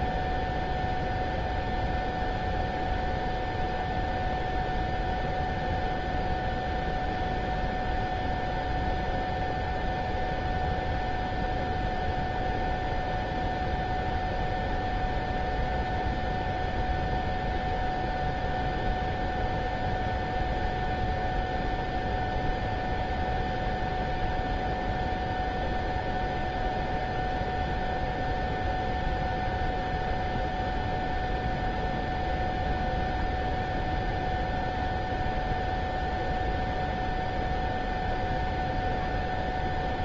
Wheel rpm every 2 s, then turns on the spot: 0, 0, 0, 0, 0, 0, 0, 0, 0, 0, 0, 0, 0, 0, 0, 0, 0, 0, 0, 0.
none